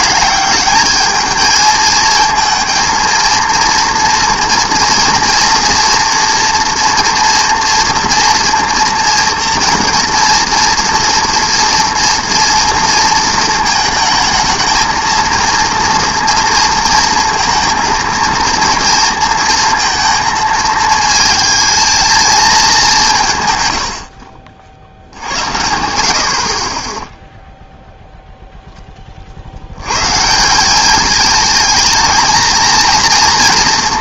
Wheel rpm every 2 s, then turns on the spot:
210, 230, 230, 230, 240, 230, 230, 220, 230, 230, 220, 210, 60, 30, 10, 190, 230.
none